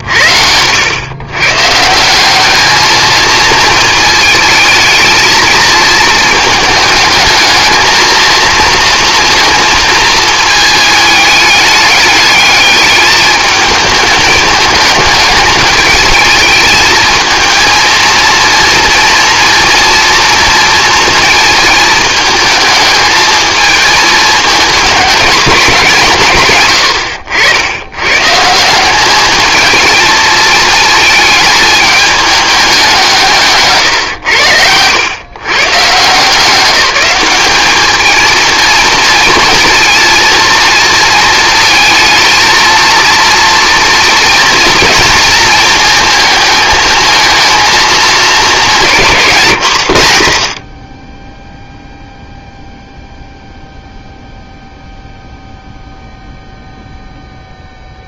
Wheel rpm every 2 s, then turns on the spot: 100, 210, 220, 220, 230, 220, 210, 210, 220, 230, 230, 220, 220, 110, 180, 220, 190, 90, 190, 230, 230, 230, 230, 220, 180, 30, 0, 0, 0.
none